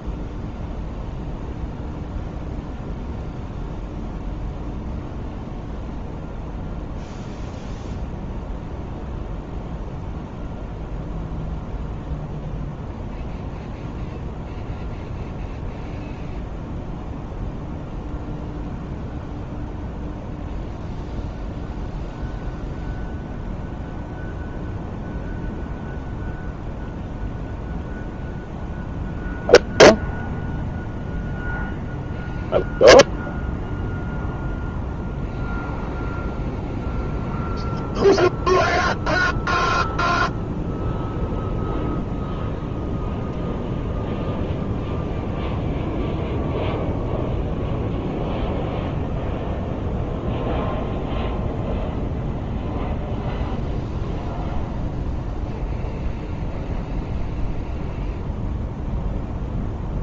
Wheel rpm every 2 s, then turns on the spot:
0, 0, 0, 0, 0, 0, 0, 0, 0, 0, 0, 0, 0, 0, 0, 0, 0, 0, 0, 0, 0, 0, 0, 0, 0, 0, 0, 0, 0, 0.
none